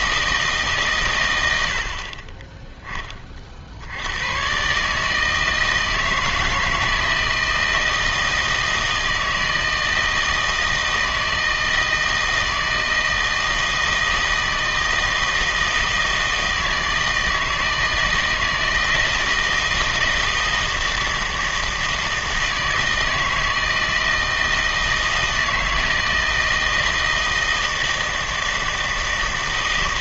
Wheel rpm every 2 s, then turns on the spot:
150, 10, 130, 160, 160, 160, 160, 160, 160, 160, 160, 160, 160, 160, 160.
none